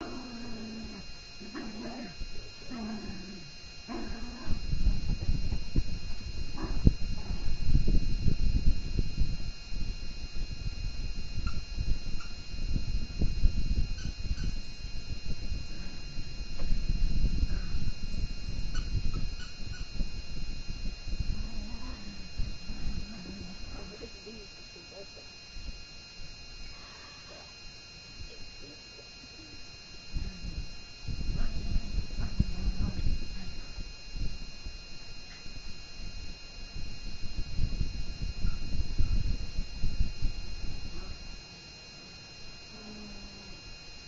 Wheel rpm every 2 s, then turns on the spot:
0, 0, 0, 0, 0, 0, 0, 0, 0, 0, 0, 0, 0, 0, 0, 0, 0, 0, 0, 0, 0, 0.
none